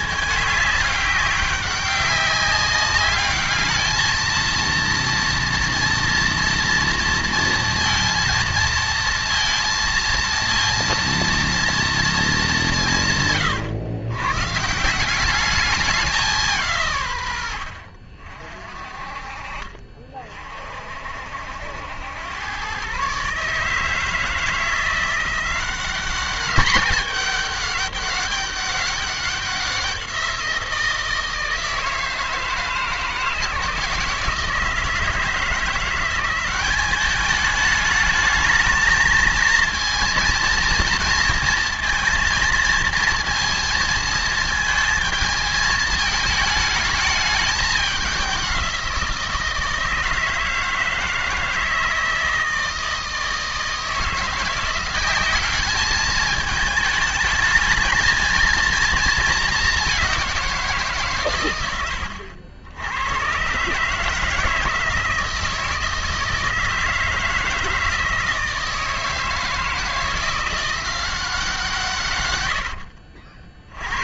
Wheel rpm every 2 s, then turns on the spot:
210, 200, 230, 230, 230, 230, 190, 140, 140, 40, 50, 120, 170, 210, 200, 170, 160, 160, 190, 220, 230, 220, 220, 210, 180, 160, 160, 180, 220, 220, 170, 80, 160, 160, 160, 180, 80.
72-74